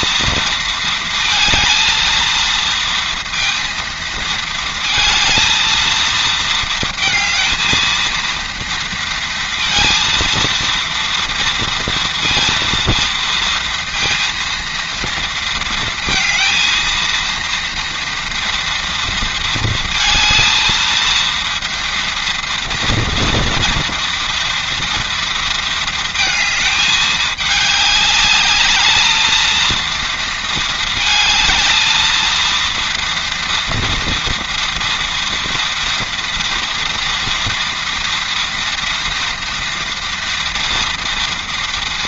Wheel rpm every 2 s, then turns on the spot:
230, 230, 220, 220, 230, 230, 230, 230, 230, 230, 230, 230, 230, 210, 210, 220, 230, 230, 230, 230, 230.
none